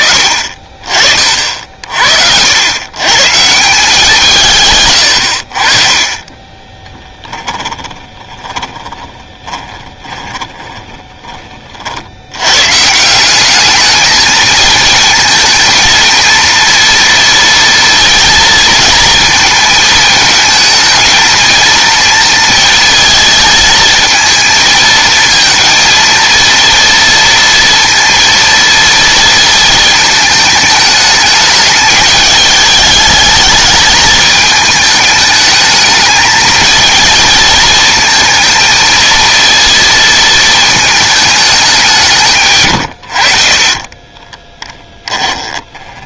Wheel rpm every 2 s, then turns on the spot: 30, 110, 140, 20, 10, 20, 120, 220, 230, 230, 220, 230, 220, 230, 230, 210, 220, 220, 230, 230, 220, 130, 10.
4-12 44-46